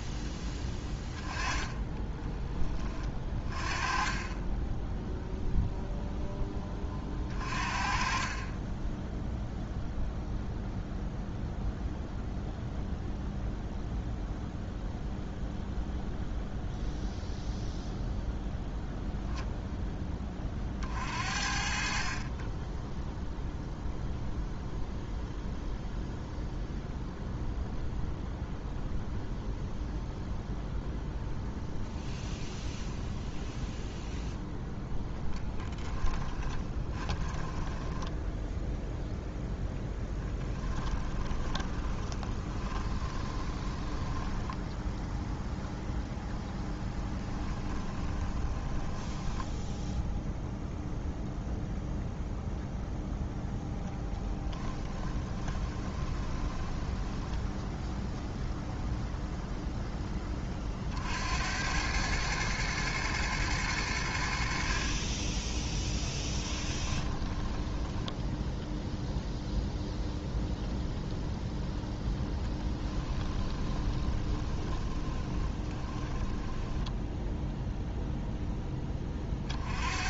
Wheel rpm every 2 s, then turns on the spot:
10, 30, 10, 20, 20, 0, 0, 0, 0, 0, 40, 10, 0, 0, 0, 0, 0, 0, 20, 0, 10, 20, 0, 10, 10, 0, 0, 10, 10, 0, 50, 110, 40, 10, 0, 0, 20, 20, 10, 20.
0-2 4-6 8-10 36-38 40-44 46-50 54-58 66-68 72-78